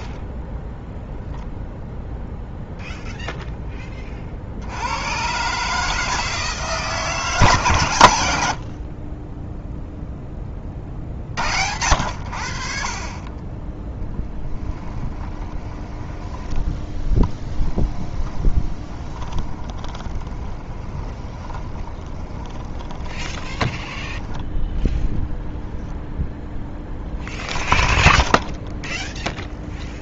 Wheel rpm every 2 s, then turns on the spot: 20, 0, 80, 150, 50, 30, 50, 10, 10, 20, 20, 20, 20, 10, 10.
0-2 14-24